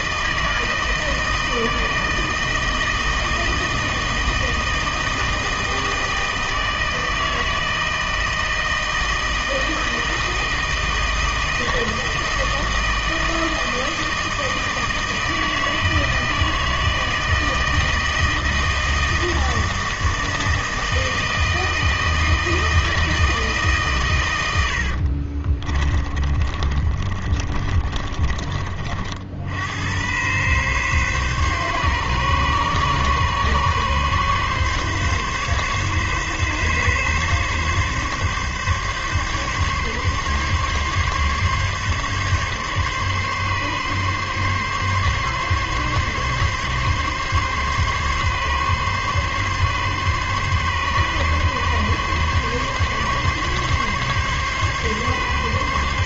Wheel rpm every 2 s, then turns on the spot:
160, 160, 160, 160, 160, 160, 160, 160, 160, 160, 160, 160, 80, 30, 40, 130, 140, 140, 140, 140, 140, 140, 140, 140, 140, 140, 140, 140.
26-28